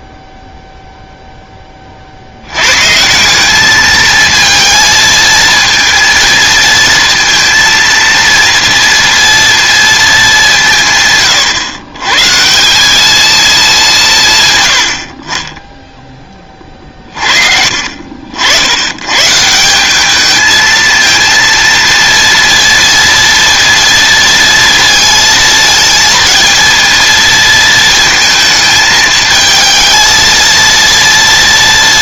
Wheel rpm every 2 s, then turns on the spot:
0, 100, 220, 230, 230, 180, 170, 120, 30, 80, 220, 230, 230, 230, 220, 230.
none